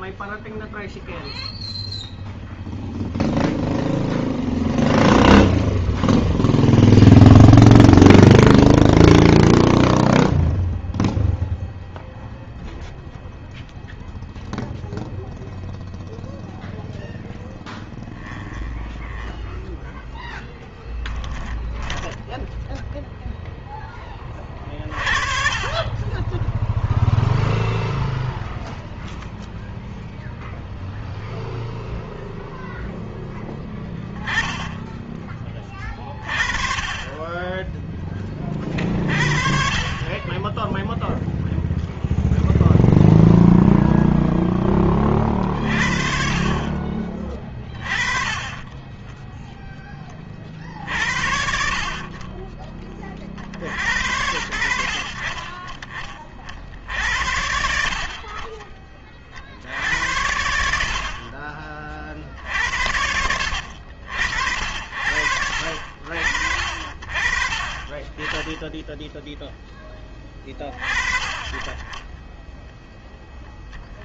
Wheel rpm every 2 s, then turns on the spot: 0, 0, 0, 0, 0, 0, 0, 0, 0, 10, 10, 10, 30, 20, 0, 0, 0, 10, 40, 30, 20, 0, 0, 40, 20, 30, 30, 70, 30, 40, 80, 60, 70, 60, 10, 20, 10.
18-24 48-50